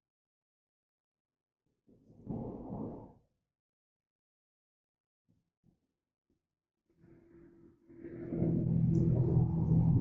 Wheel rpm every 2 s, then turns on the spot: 0, 0, 0, 0, 0.
none